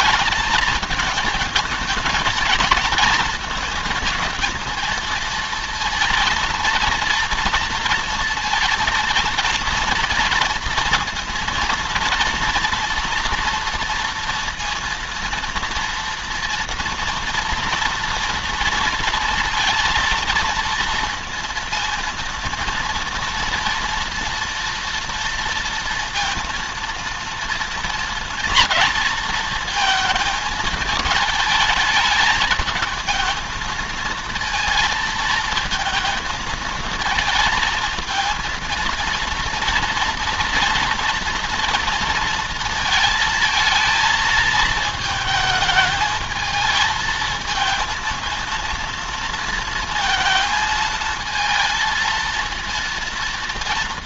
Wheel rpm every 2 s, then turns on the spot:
220, 220, 220, 230, 230, 230, 230, 230, 230, 230, 230, 230, 230, 230, 230, 220, 220, 220, 220, 230, 230, 230, 220, 220, 230, 230, 230.
none